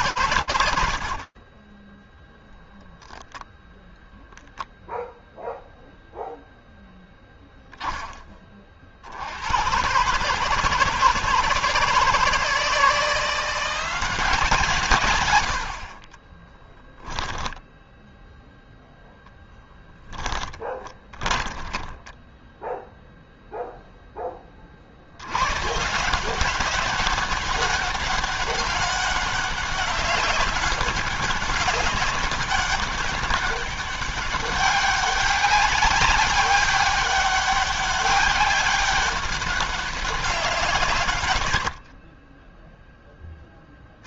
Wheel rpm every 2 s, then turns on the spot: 10, 0, 0, 10, 130, 160, 180, 50, 10, 10, 20, 0, 90, 200, 200, 200, 200, 200, 200, 200, 130, 10.
0-2 18-22